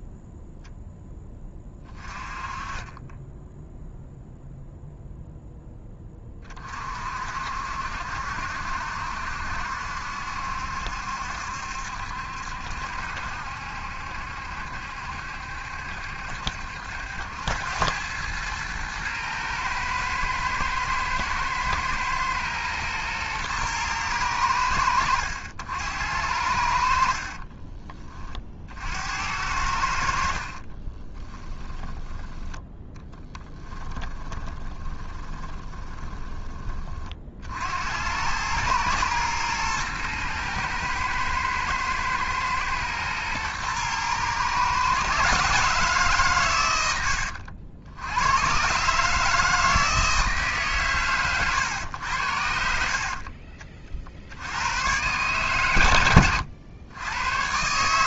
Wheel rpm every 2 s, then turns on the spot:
0, 20, 0, 40, 60, 70, 70, 70, 70, 110, 110, 120, 90, 80, 50, 40, 10, 20, 30, 110, 110, 110, 130, 110, 130, 150, 70, 90, 100.
30-32 34-36